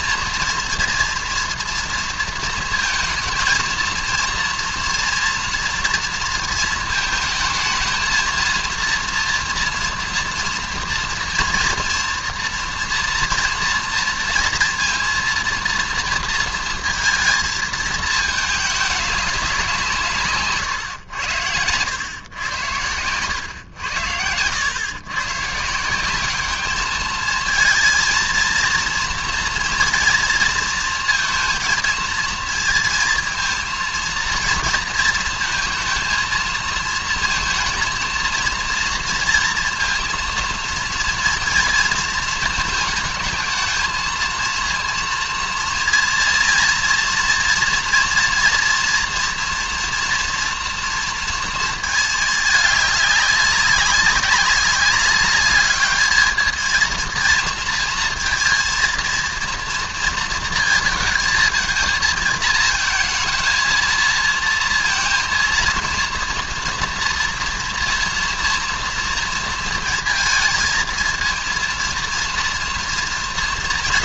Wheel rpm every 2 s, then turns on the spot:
240, 230, 240, 230, 230, 230, 240, 230, 230, 210, 120, 100, 110, 210, 230, 230, 230, 230, 230, 230, 230, 220, 230, 230, 230, 230, 210, 190, 220, 230, 230, 220, 230, 230, 230, 220, 230.
none